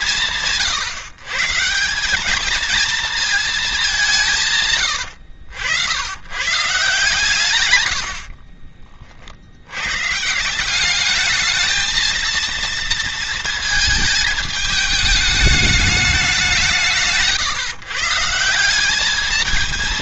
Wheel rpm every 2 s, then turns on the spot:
170, 210, 170, 130, 60, 150, 230, 220, 190, 170.
8-10